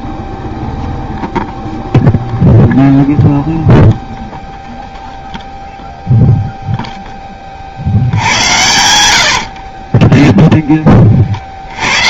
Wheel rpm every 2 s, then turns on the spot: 20, 0, 0, 0, 80, 10.
none